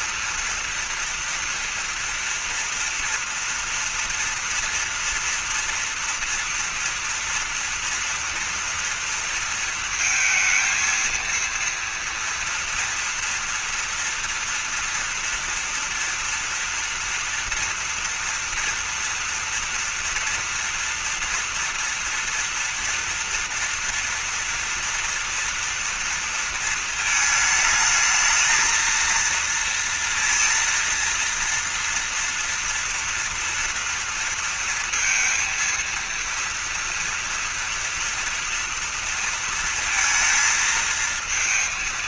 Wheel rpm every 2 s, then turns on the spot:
230, 230, 230, 230, 230, 220, 230, 240, 230, 230, 230, 230, 230, 230, 220, 230, 230, 230, 230, 230, 230.
none